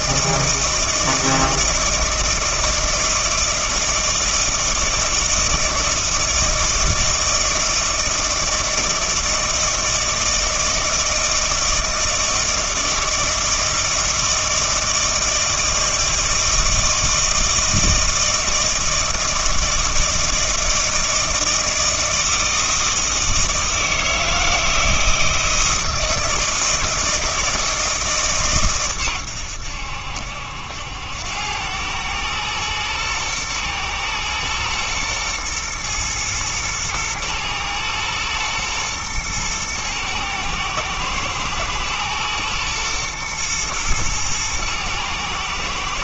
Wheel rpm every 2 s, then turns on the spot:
160, 160, 160, 160, 160, 160, 160, 160, 160, 160, 160, 160, 160, 160, 130, 80, 110, 110, 120, 120, 120, 120, 110.
none